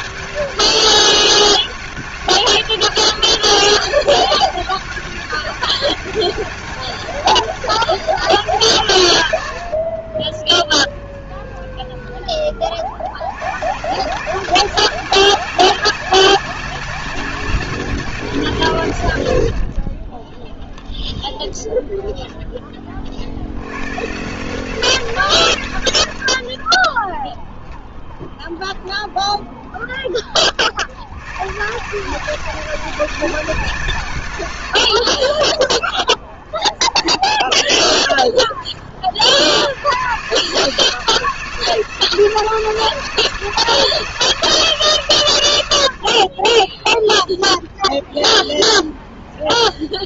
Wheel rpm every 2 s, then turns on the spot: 200, 200, 200, 200, 130, 30, 90, 190, 200, 120, 10, 30, 180, 40, 20, 90, 200, 80, 30, 40, 170, 170, 150, 20, 20.
20-22